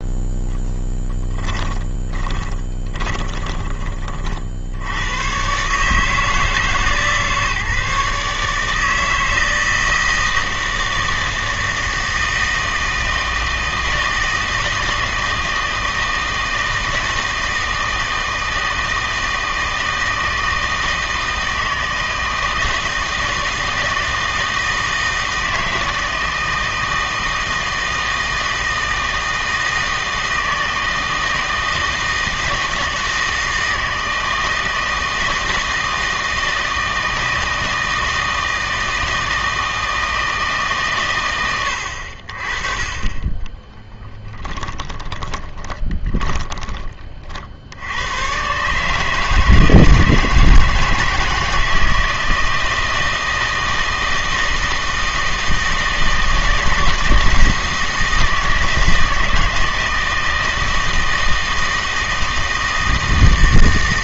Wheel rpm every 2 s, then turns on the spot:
10, 20, 70, 150, 160, 160, 160, 160, 160, 160, 160, 160, 160, 160, 160, 160, 160, 160, 160, 160, 140, 30, 20, 40, 140, 160, 160, 160, 160, 160, 160, 160.
0-4 44-46